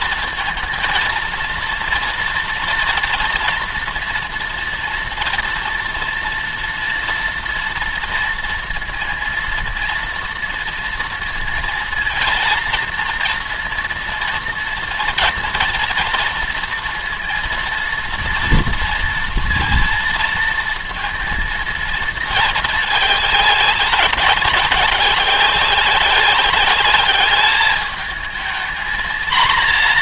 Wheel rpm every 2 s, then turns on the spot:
230, 230, 230, 230, 230, 230, 230, 230, 230, 230, 230, 220, 190, 190, 220.
none